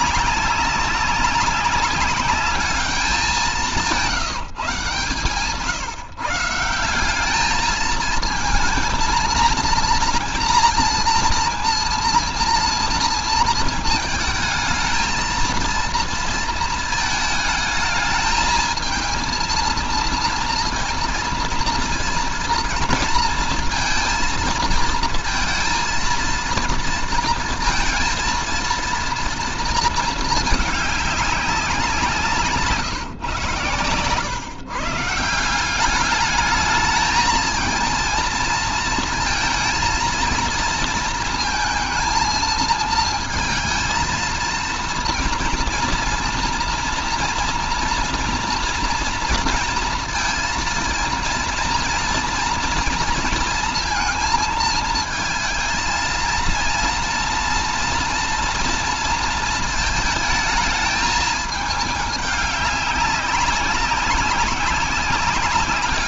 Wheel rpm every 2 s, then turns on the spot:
200, 200, 160, 170, 220, 230, 240, 220, 220, 220, 230, 230, 230, 230, 230, 220, 160, 150, 210, 230, 230, 230, 230, 230, 230, 230, 230, 220, 230, 230, 220, 200, 190.
none